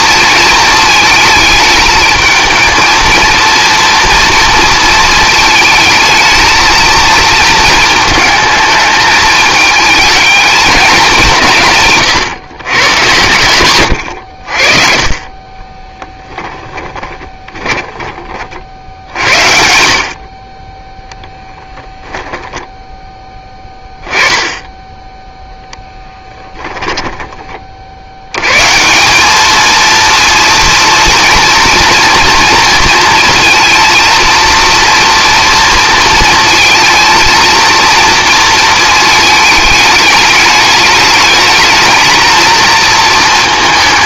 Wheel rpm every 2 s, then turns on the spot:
220, 230, 230, 220, 220, 200, 130, 50, 20, 60, 10, 10, 10, 10, 170, 230, 230, 230, 230, 220, 210, 230.
16-18 26-28